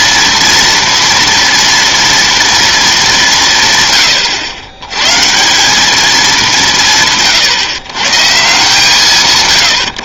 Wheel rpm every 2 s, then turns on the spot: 230, 220, 110, 160, 160.
none